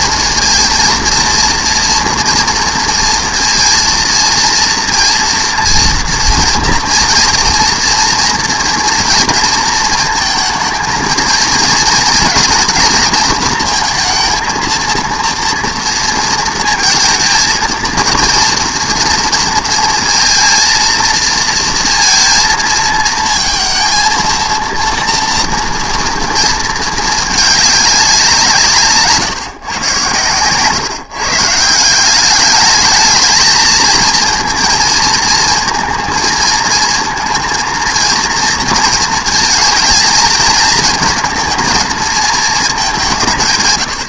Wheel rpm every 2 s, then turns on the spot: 230, 230, 230, 230, 230, 220, 230, 230, 230, 230, 230, 230, 230, 220, 170, 130, 210, 230, 220, 230, 230, 220.
none